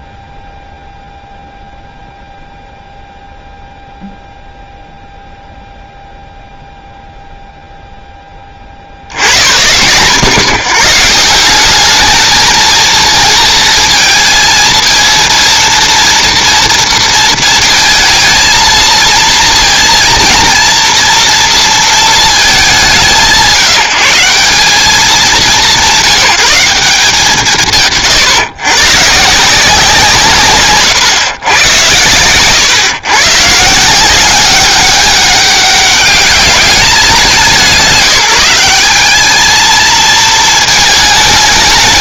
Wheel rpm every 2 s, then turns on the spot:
0, 0, 0, 0, 80, 160, 230, 230, 230, 230, 230, 170, 190, 140, 140, 110, 130, 200, 180, 220, 220.
none